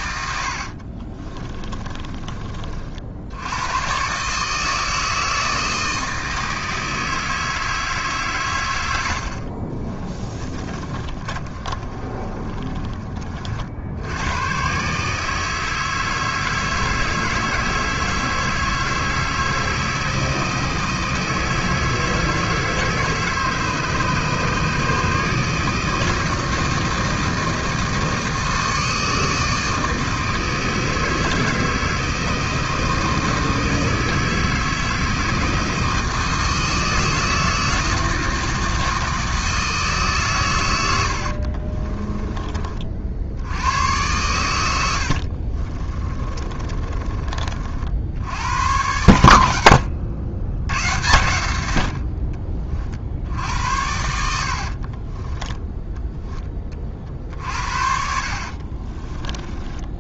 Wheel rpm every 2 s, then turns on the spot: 60, 60, 160, 160, 80, 30, 30, 130, 160, 160, 160, 160, 150, 160, 160, 160, 160, 160, 160, 160, 100, 50, 80, 30, 110, 100, 40, 40, 30, 30.
0-2 10-14 40-42 46-48 54-56 58-60